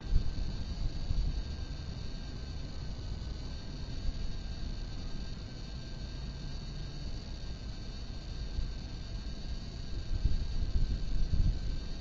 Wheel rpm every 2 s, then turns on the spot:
0, 0, 0, 0, 0, 0.
none